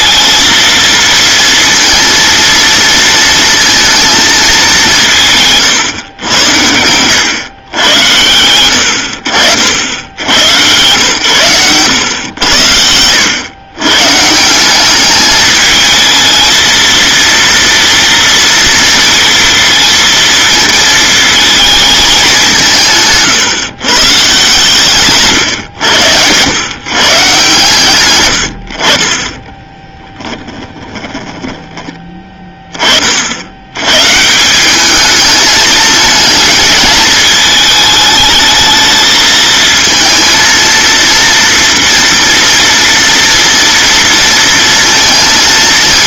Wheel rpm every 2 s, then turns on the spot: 230, 230, 200, 100, 80, 110, 90, 180, 230, 230, 230, 160, 140, 120, 70, 20, 30, 200, 220, 220, 230, 230, 230.
6-8 30-32